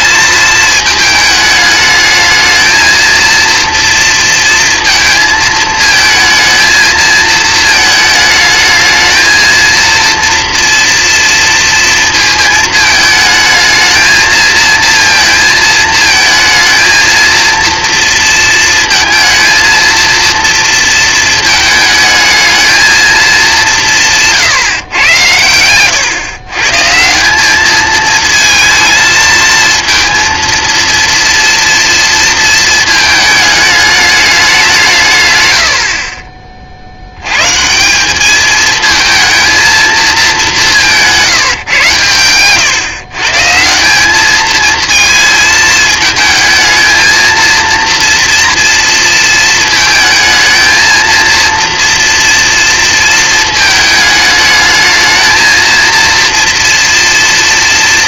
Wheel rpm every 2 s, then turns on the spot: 220, 230, 230, 220, 220, 230, 220, 230, 220, 230, 230, 220, 120, 140, 220, 230, 220, 150, 50, 220, 180, 130, 220, 220, 230, 220, 230, 220, 230.
none